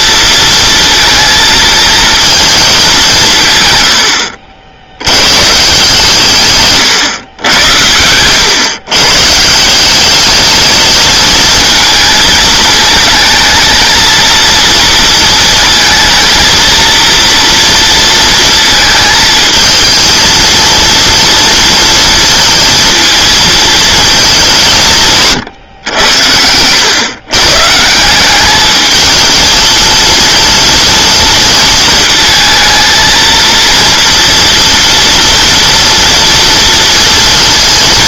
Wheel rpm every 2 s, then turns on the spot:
230, 220, 80, 130, 120, 220, 230, 230, 230, 230, 230, 230, 180, 100, 210, 230, 230, 230, 230.
none